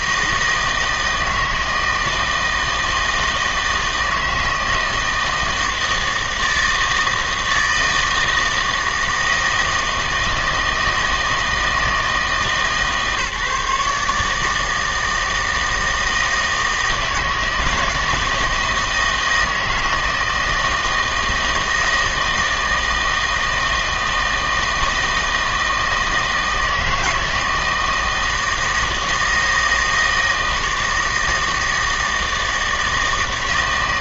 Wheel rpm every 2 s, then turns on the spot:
160, 160, 160, 160, 160, 160, 150, 160, 160, 160, 160, 160, 160, 160, 160, 160, 160.
none